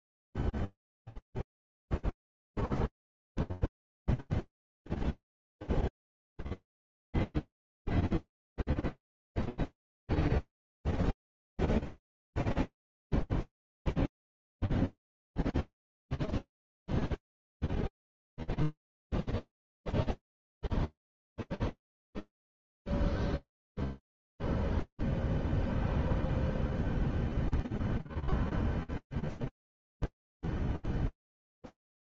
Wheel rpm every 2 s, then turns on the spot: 0, 0, 0, 0, 0, 0, 0, 0, 0, 0, 0, 0, 0, 0, 0, 0.
none